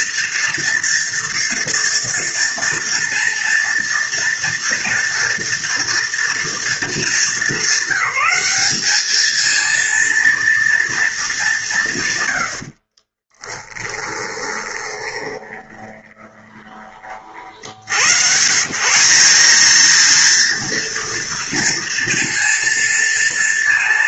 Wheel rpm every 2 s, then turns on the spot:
230, 230, 230, 210, 210, 220, 30, 20, 40, 190, 230, 230.
12-16